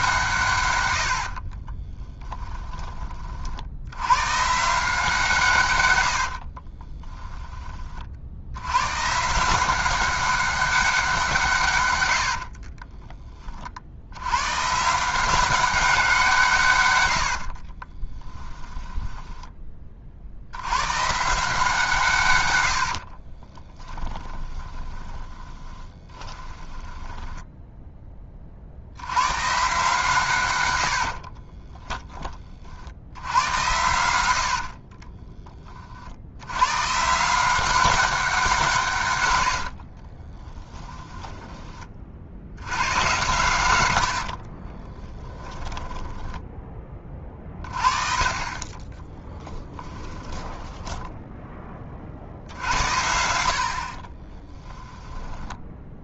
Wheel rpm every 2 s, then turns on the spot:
100, 30, 160, 30, 120, 190, 30, 140, 120, 10, 110, 70, 20, 10, 70, 90, 60, 50, 130, 150, 10, 100, 30, 20, 20, 10, 70, 10.
2-4 6-8 12-14 18-20 24-28 30-32 34-36 40-42 44-46 48-52 54-56